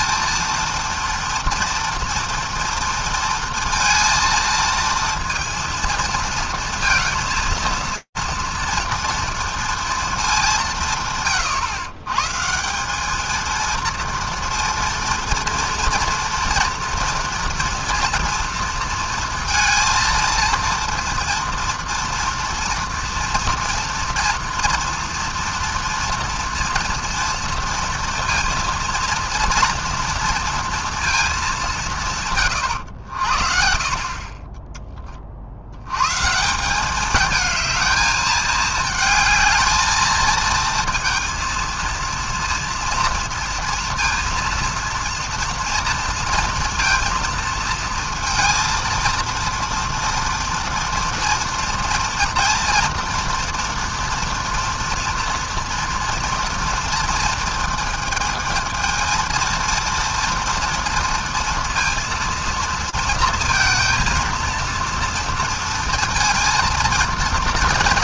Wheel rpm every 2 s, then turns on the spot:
230, 230, 230, 230, 230, 180, 160, 230, 230, 230, 230, 230, 240, 230, 230, 230, 140, 20, 160, 220, 230, 230, 230, 230, 230, 230, 230, 240, 230, 220, 230, 230, 230, 230.
none